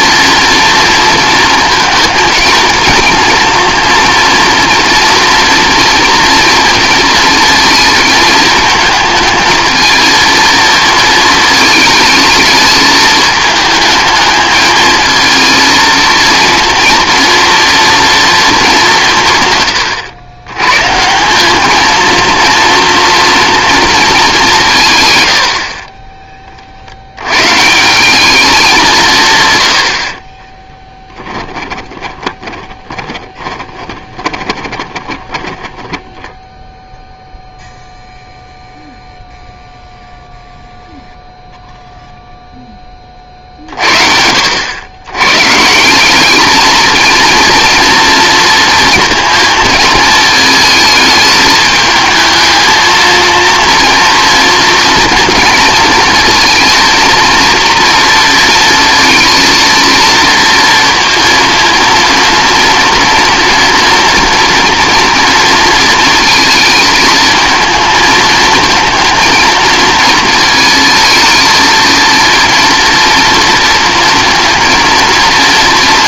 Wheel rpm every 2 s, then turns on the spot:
230, 230, 240, 230, 220, 230, 220, 220, 230, 210, 120, 230, 180, 30, 200, 20, 20, 20, 0, 0, 0, 10, 80, 220, 230, 220, 220, 230, 230, 230, 230, 230, 230, 220, 220, 220, 230, 230.
30-36